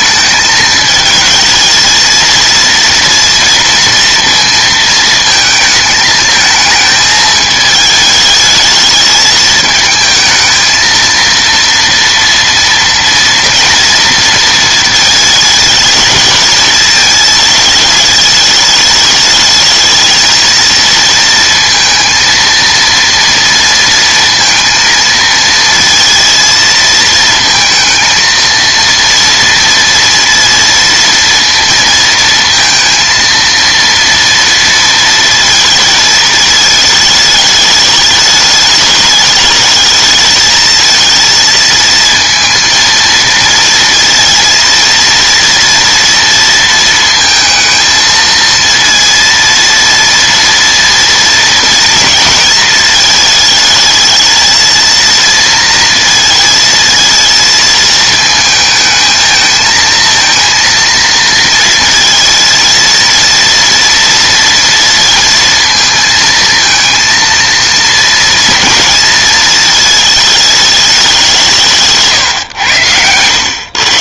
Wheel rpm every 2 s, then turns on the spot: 220, 230, 220, 220, 220, 220, 230, 220, 220, 210, 230, 230, 230, 220, 230, 230, 230, 230, 210, 210, 230, 230, 230, 230, 230, 230, 220, 230, 220, 220, 230, 230, 230, 230, 230, 200, 110.
none